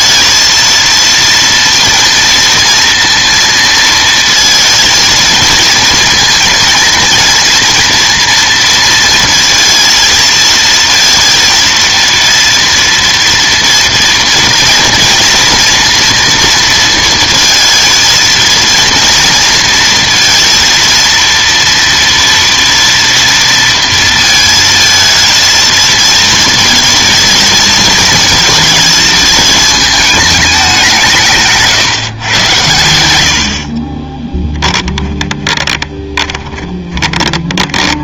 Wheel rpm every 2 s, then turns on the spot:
230, 230, 230, 230, 230, 230, 230, 230, 230, 230, 230, 230, 230, 230, 220, 190, 110, 10, 20.
34-38